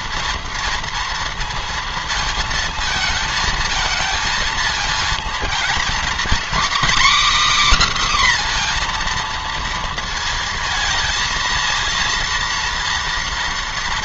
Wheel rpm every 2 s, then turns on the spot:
230, 220, 220, 260, 250, 230, 230.
none